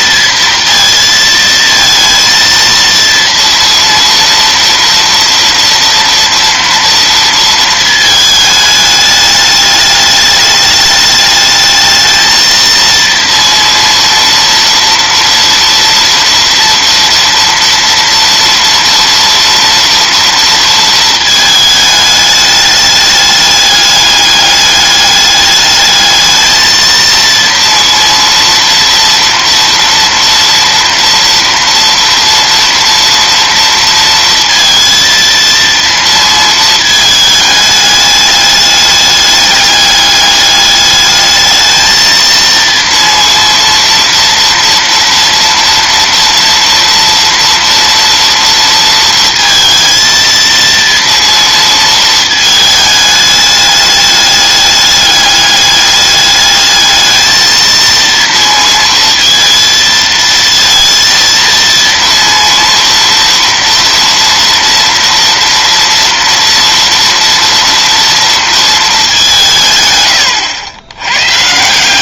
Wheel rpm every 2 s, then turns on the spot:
230, 230, 230, 230, 210, 210, 230, 230, 230, 230, 230, 210, 200, 220, 230, 230, 230, 230, 220, 210, 210, 230, 230, 230, 230, 230, 220, 210, 210, 230, 230, 230, 230, 230, 230, 100.
none